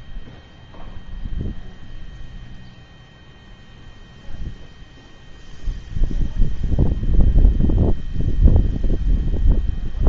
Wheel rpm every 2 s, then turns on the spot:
0, 0, 0, 0, 0.
none